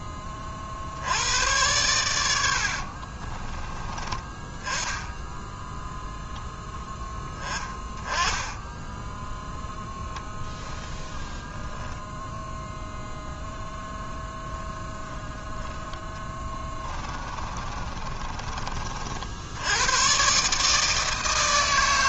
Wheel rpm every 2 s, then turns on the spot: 80, 50, 10, 10, 10, 0, 0, 10, 20, 50, 160.
2-4 16-18